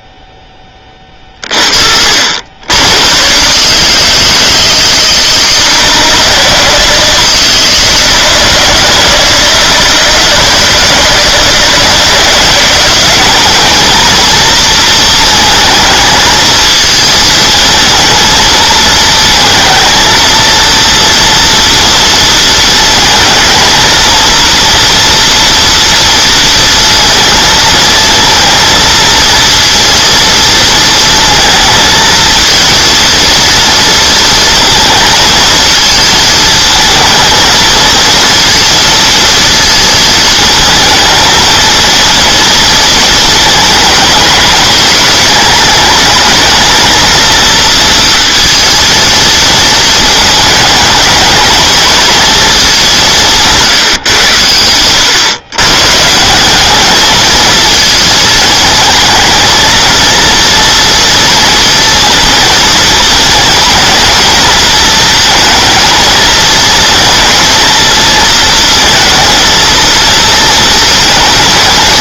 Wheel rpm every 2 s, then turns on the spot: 0, 70, 160, 160, 150, 160, 170, 230, 220, 220, 230, 230, 230, 230, 230, 230, 230, 220, 220, 220, 220, 230, 220, 220, 230, 220, 220, 130, 170, 220, 230, 230, 220, 220, 220, 230.
none